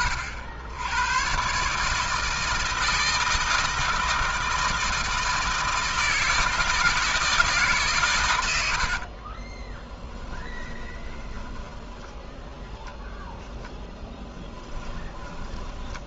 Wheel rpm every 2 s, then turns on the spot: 100, 160, 160, 160, 70, 20, 0, 20.
8-12